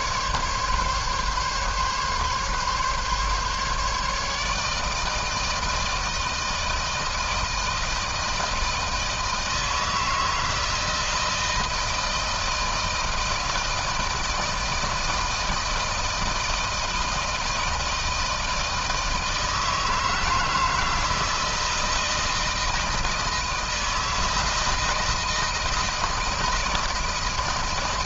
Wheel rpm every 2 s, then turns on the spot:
140, 140, 150, 160, 160, 160, 160, 160, 160, 160, 160, 160, 160, 160.
none